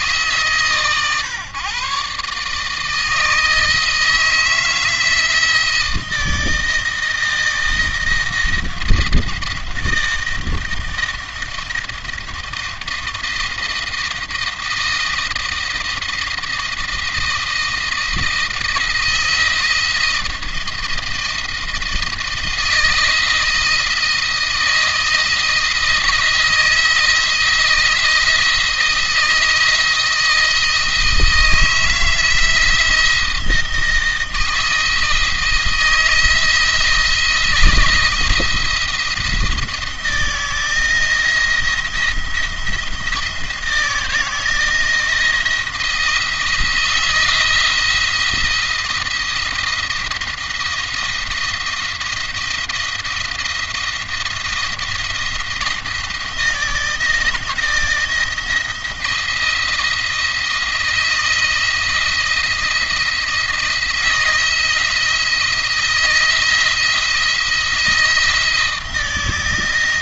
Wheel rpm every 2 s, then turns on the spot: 140, 150, 160, 160, 160, 160, 160, 160, 170, 160, 170, 160, 170, 160, 160, 160, 160, 160, 160, 170, 160, 170, 160, 160, 170, 170, 170, 170, 170, 160, 170, 170, 170, 160, 160.
none